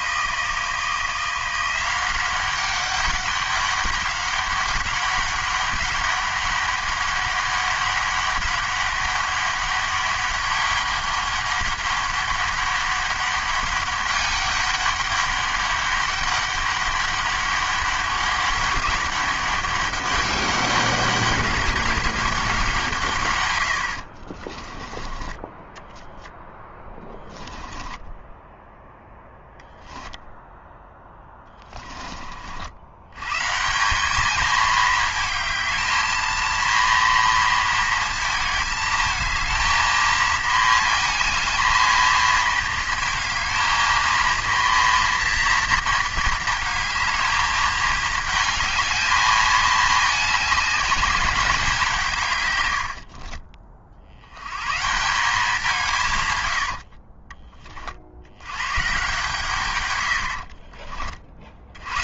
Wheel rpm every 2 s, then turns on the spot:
160, 190, 200, 200, 200, 200, 200, 200, 200, 200, 200, 170, 30, 10, 10, 10, 60, 220, 230, 220, 220, 220, 230, 220, 220, 210, 100, 110, 100, 120, 50.
24-32 52-54 56-58 60-62